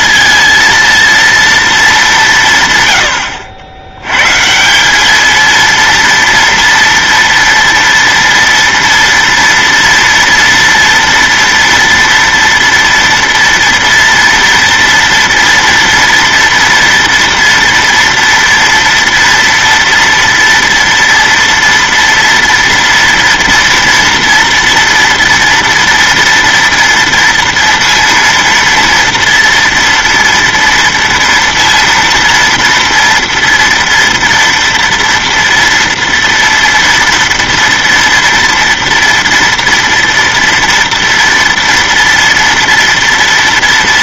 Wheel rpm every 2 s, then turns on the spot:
230, 130, 160, 230, 230, 230, 230, 240, 230, 230, 230, 230, 230, 230, 230, 230, 230, 230, 230, 230, 230, 230.
none